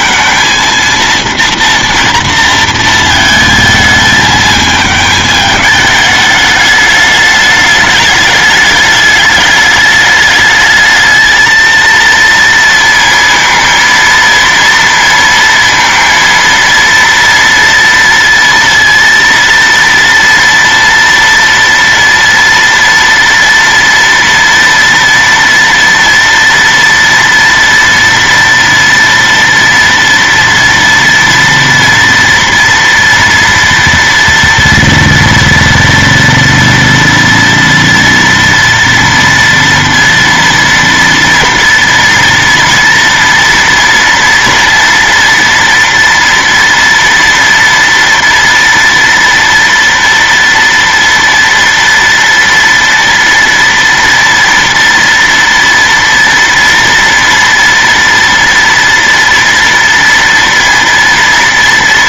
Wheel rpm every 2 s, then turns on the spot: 230, 230, 220, 210, 210, 220, 230, 230, 230, 230, 230, 230, 230, 230, 230, 230, 240, 240, 240, 230, 230, 230, 230, 240, 230, 230, 230, 230, 230, 230, 230.
none